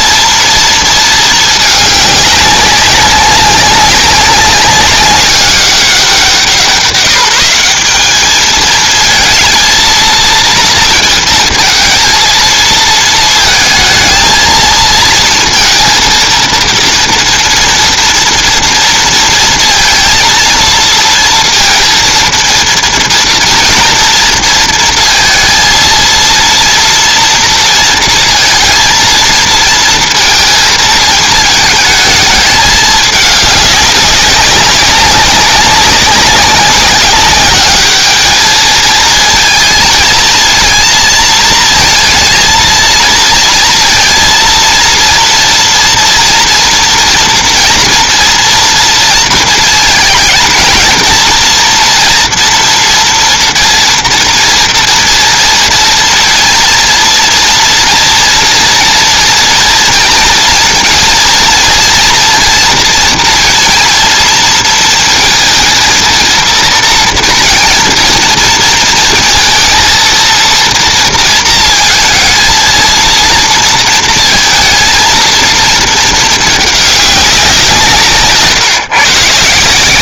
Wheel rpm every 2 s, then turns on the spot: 230, 200, 190, 180, 220, 230, 220, 230, 230, 230, 230, 230, 230, 230, 230, 220, 220, 190, 200, 220, 230, 220, 230, 230, 230, 230, 230, 230, 230, 230, 230, 220, 220, 230, 230, 230, 220, 230, 210, 150.
none